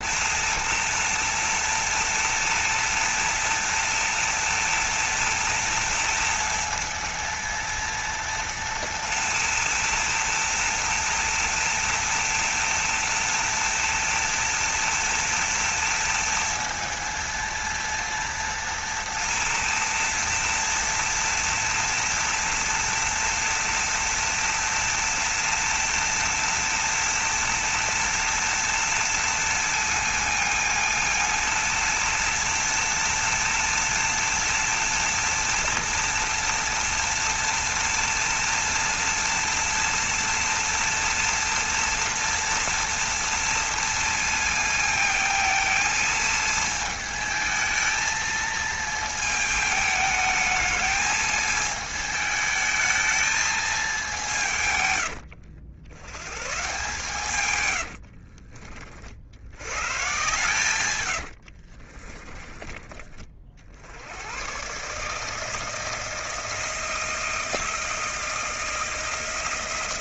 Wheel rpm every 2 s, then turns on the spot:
230, 230, 230, 230, 230, 230, 230, 230, 230, 230, 230, 230, 230, 230, 230, 230, 230, 230, 230, 230, 230, 230, 220, 220, 220, 220, 220, 110, 150, 60, 100, 40, 150, 160, 160.
60-62